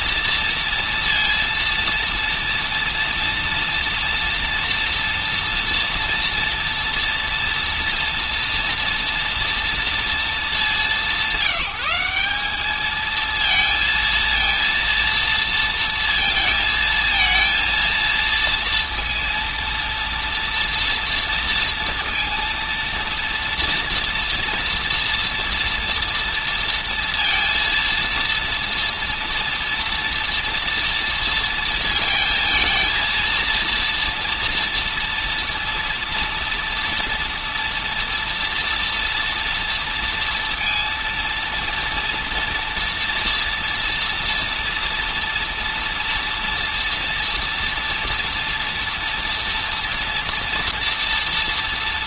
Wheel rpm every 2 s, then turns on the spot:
230, 240, 230, 240, 230, 200, 210, 230, 230, 230, 230, 230, 230, 230, 230, 230, 230, 230, 230, 230, 230, 240, 230, 230, 230, 230.
none